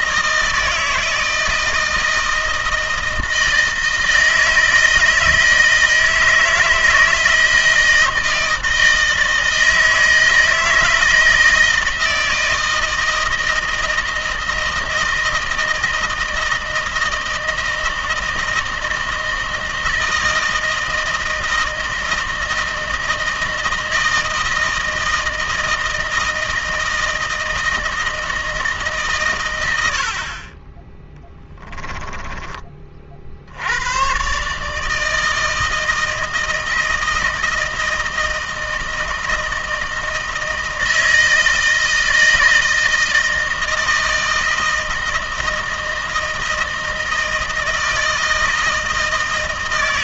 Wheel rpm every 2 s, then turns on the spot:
160, 160, 160, 160, 160, 160, 160, 160, 160, 160, 160, 160, 160, 160, 150, 20, 40, 150, 160, 160, 160, 160, 160, 160, 160.
none